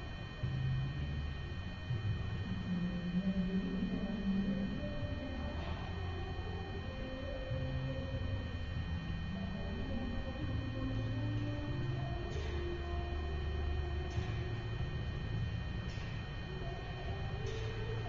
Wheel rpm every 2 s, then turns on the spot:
0, 0, 0, 0, 0, 0, 0, 0, 0.
none